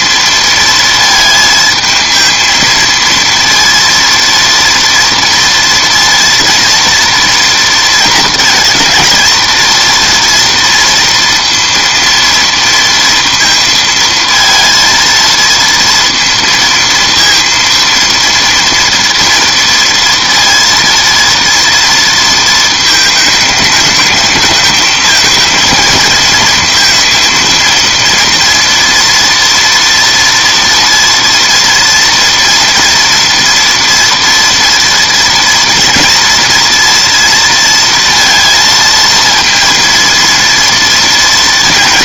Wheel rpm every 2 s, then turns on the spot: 230, 230, 230, 230, 220, 230, 230, 230, 230, 230, 230, 220, 220, 230, 230, 230, 230, 230, 230, 230, 230.
none